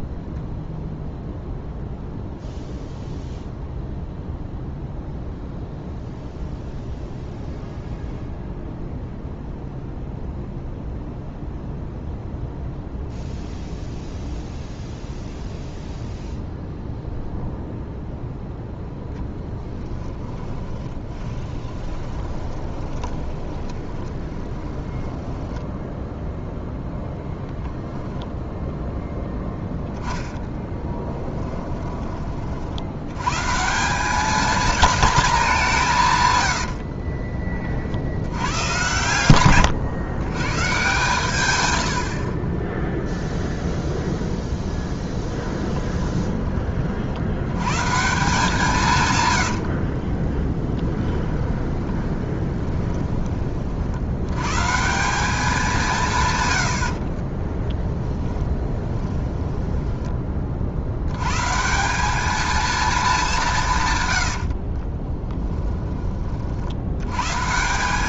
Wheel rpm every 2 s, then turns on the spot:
10, 0, 0, 0, 0, 0, 0, 0, 0, 0, 10, 20, 20, 0, 0, 10, 60, 230, 80, 110, 130, 20, 0, 30, 170, 20, 20, 140, 90, 20, 50, 220, 50, 60.
0-2 20-26 30-32 36-38 50-54 58-60 64-66